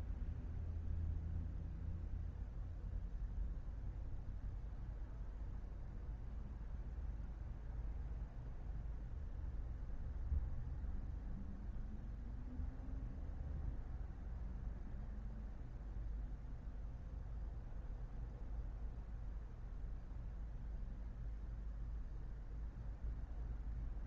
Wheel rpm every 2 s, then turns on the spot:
0, 0, 0, 0, 0, 0, 0, 0, 0, 0, 0, 0.
none